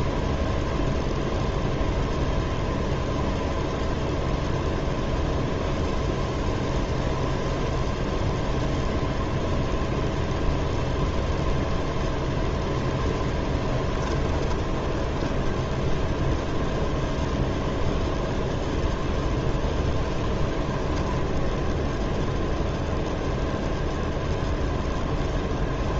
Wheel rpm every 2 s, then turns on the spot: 0, 0, 0, 0, 0, 0, 0, 10, 0, 0, 10, 0, 0.
14-16 20-22